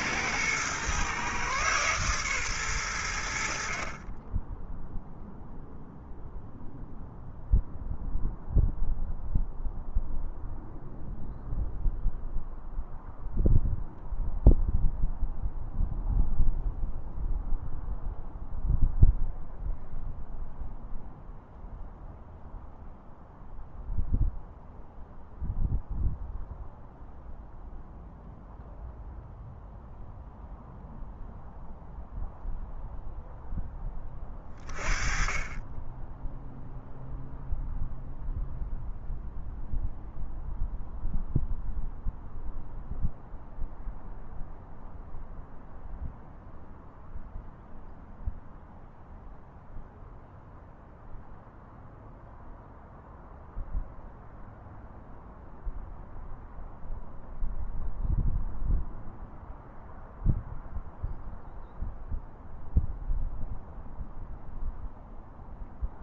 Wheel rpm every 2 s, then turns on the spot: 120, 100, 0, 0, 0, 0, 0, 0, 0, 0, 0, 0, 0, 0, 0, 0, 0, 20, 0, 0, 0, 0, 0, 0, 0, 0, 0, 0, 0, 0, 0, 0, 0.
none